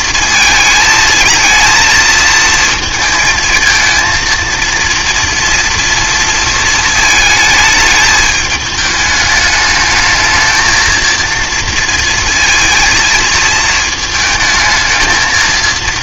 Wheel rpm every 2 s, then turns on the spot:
230, 230, 230, 230, 220, 220, 230, 220.
none